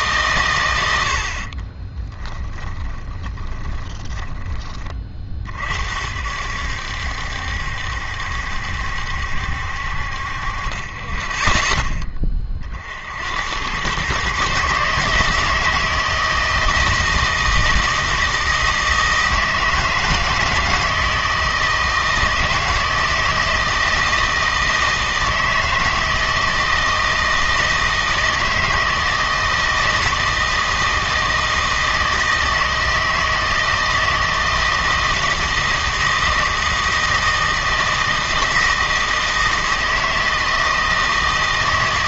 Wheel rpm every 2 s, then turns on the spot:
100, 20, 20, 70, 70, 30, 40, 150, 160, 160, 160, 160, 160, 160, 160, 160, 160, 160, 160, 160, 160.
2-4